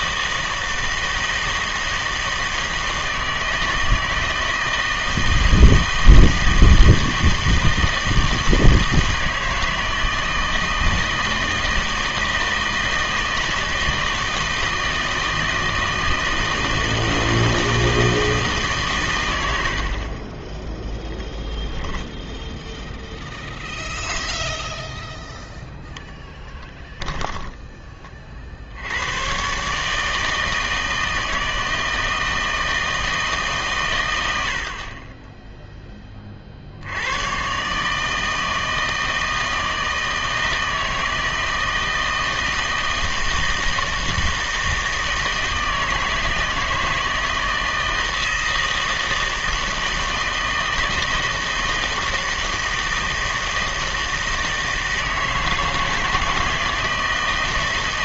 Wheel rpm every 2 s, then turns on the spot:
160, 160, 160, 160, 160, 160, 160, 160, 160, 150, 10, 0, 0, 10, 70, 160, 160, 50, 60, 160, 160, 160, 160, 160, 160, 160, 160, 160, 160.
26-28 34-36